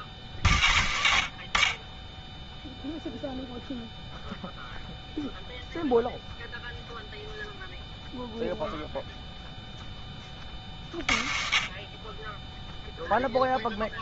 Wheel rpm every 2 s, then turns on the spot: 20, 0, 0, 0, 0, 30, 10.
none